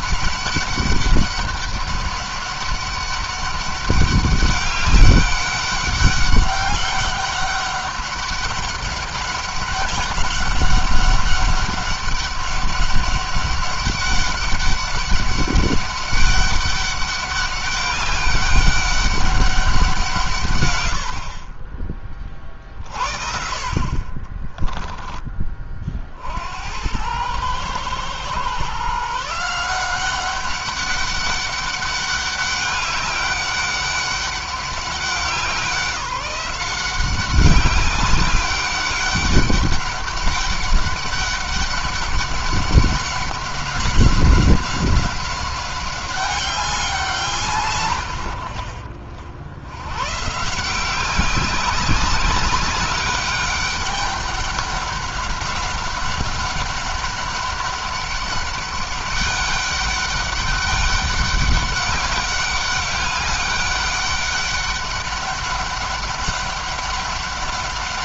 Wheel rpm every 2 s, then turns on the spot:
200, 200, 200, 200, 200, 190, 200, 200, 200, 200, 100, 40, 20, 90, 140, 190, 200, 190, 190, 200, 200, 200, 190, 190, 90, 170, 200, 200, 190, 200, 200, 200, 200, 190.
none